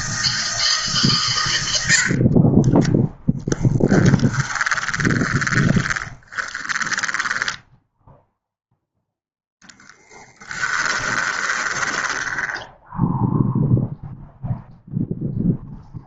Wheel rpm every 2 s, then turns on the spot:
150, 20, 20, 20, 0, 20, 10, 0.
2-8 10-14